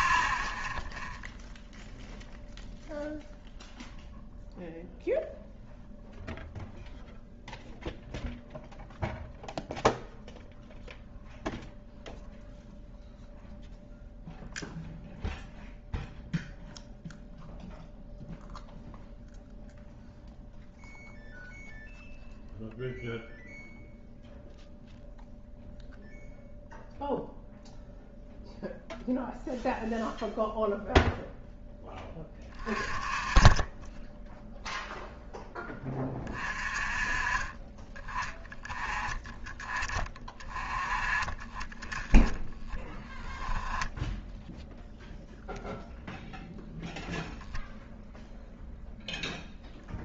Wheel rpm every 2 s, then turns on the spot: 0, 0, 0, 0, 0, 0, 0, 0, 0, 0, 0, 0, 0, 0, 0, 0, 30, 0, 30, 20, 20, 10, 0, 0, 0.
none